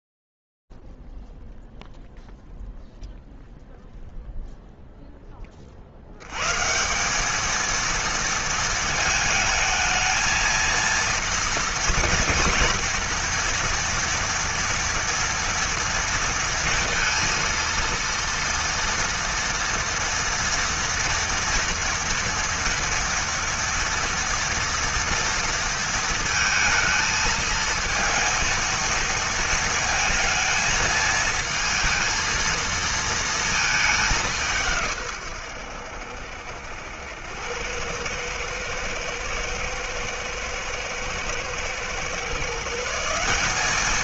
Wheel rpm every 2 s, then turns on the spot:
0, 0, 0, 140, 220, 230, 230, 230, 230, 230, 230, 230, 230, 220, 230, 220, 230, 120, 90, 110, 120, 190.
none